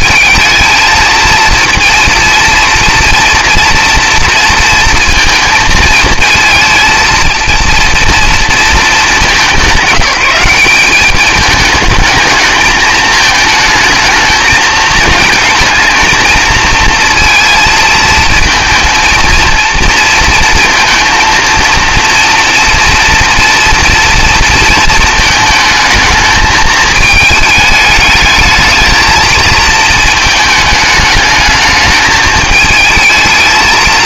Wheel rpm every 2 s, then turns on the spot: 220, 230, 230, 230, 230, 190, 220, 220, 230, 230, 230, 230, 230, 220, 220, 220, 220.
none